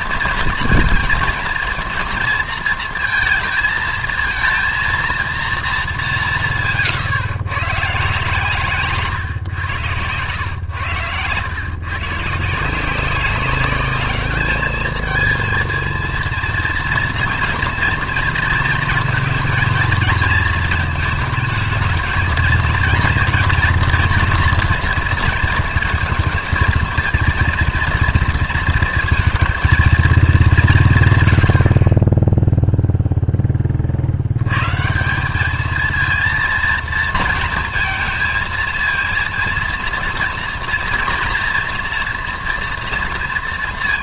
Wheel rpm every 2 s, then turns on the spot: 230, 230, 230, 150, 140, 110, 180, 220, 240, 230, 220, 230, 230, 230, 230, 120, 0, 160, 230, 230, 230, 230.
none